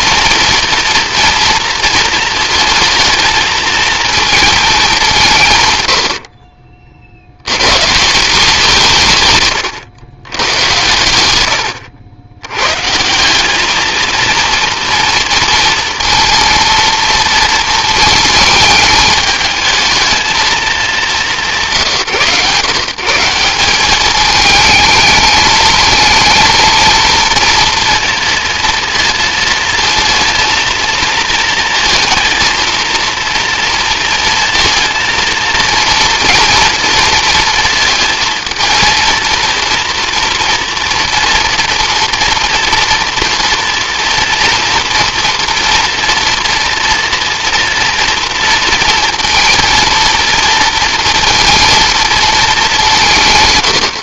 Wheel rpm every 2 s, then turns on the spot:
230, 230, 210, 60, 170, 110, 140, 230, 230, 220, 210, 140, 220, 230, 230, 230, 230, 230, 230, 230, 230, 230, 230, 230, 230, 230, 190.
none